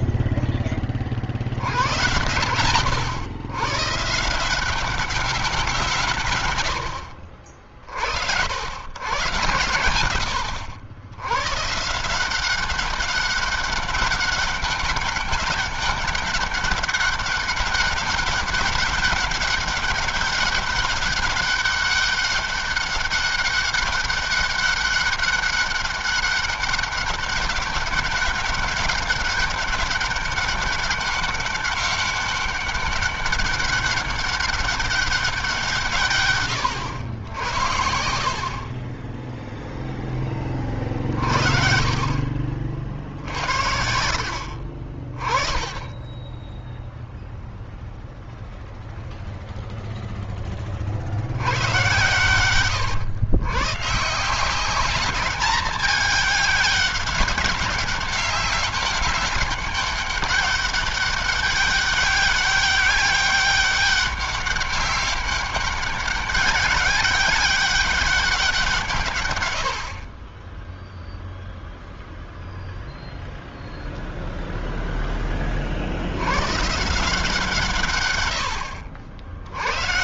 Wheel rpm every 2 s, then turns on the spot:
20, 110, 190, 90, 90, 90, 190, 200, 200, 200, 200, 200, 200, 200, 200, 200, 200, 200, 100, 30, 30, 50, 60, 10, 0, 40, 120, 200, 200, 200, 200, 200, 200, 200, 160, 10, 0, 0, 150, 80.
40-42